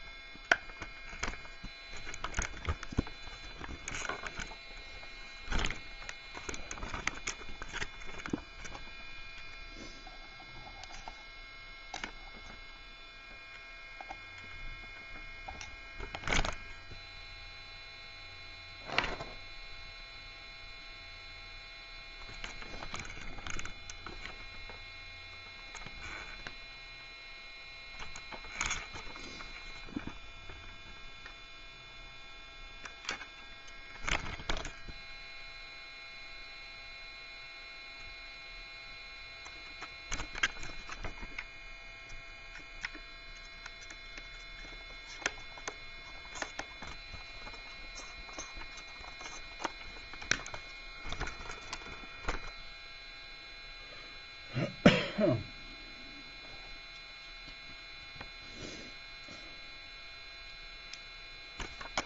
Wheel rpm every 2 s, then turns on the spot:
0, 0, 0, 0, 0, 0, 0, 0, 0, 0, 0, 0, 0, 0, 0, 0, 0, 0, 0, 0, 0, 0, 0, 0, 0, 0, 0, 0, 0, 0, 0.
none